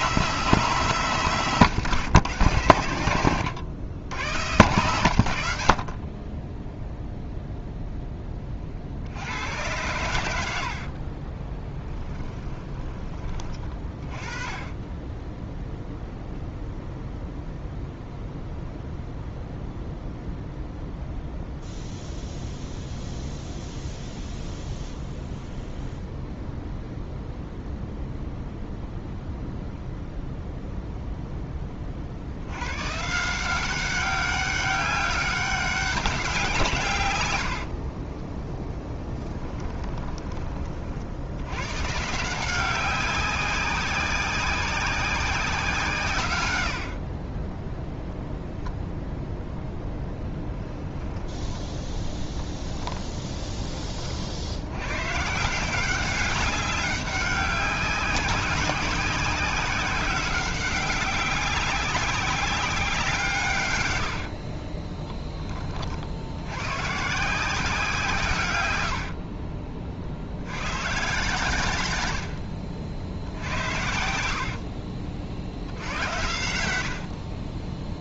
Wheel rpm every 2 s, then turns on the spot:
170, 120, 120, 0, 50, 50, 20, 20, 0, 0, 0, 0, 0, 0, 0, 0, 110, 200, 140, 10, 50, 180, 190, 70, 0, 20, 10, 100, 200, 190, 190, 180, 30, 130, 100, 110, 70, 50, 80.
52-54 64-66 68-70 74-78